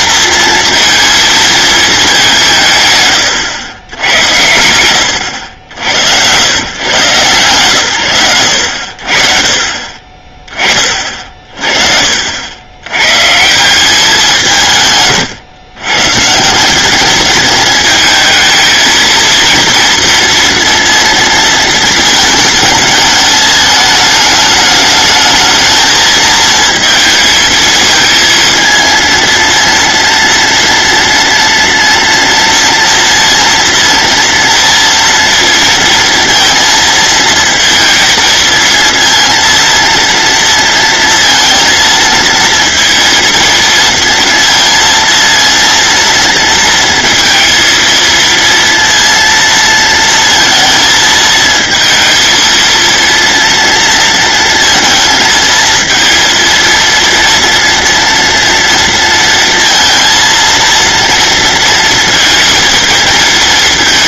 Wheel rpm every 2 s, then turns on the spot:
230, 140, 90, 120, 70, 40, 110, 140, 190, 220, 230, 220, 210, 230, 230, 230, 230, 230, 230, 230, 230, 230, 230, 230, 230, 230, 230, 230, 230, 230, 230, 230.
none